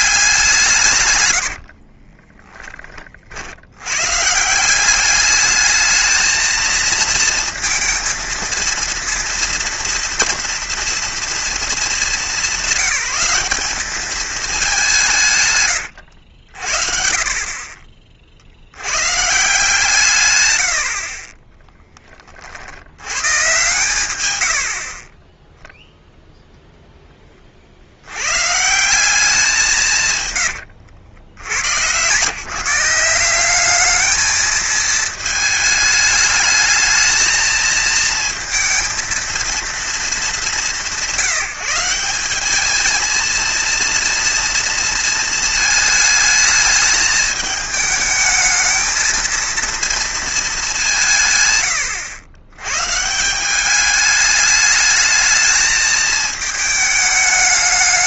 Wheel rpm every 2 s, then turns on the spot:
180, 20, 160, 220, 230, 230, 190, 200, 80, 50, 120, 40, 80, 0, 120, 130, 150, 220, 210, 220, 190, 200, 230, 220, 220, 210, 100, 210, 220.
2-4 30-32